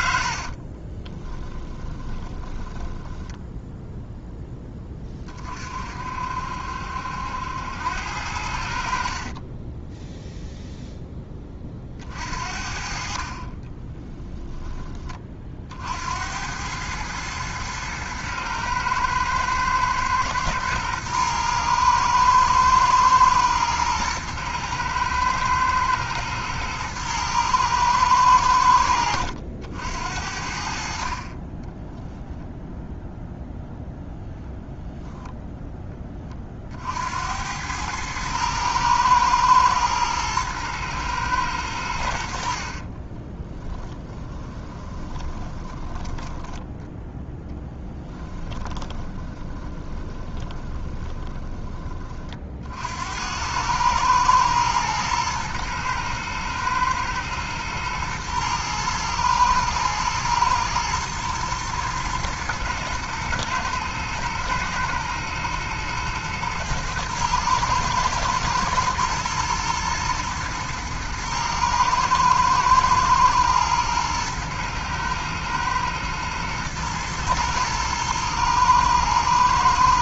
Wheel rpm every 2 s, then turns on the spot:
30, 20, 20, 70, 60, 0, 50, 20, 100, 110, 120, 110, 110, 110, 90, 60, 0, 0, 60, 110, 110, 50, 20, 10, 20, 20, 60, 110, 110, 110, 110, 120, 110, 110, 110, 110, 110, 110, 110, 110.
0-4 42-46 48-52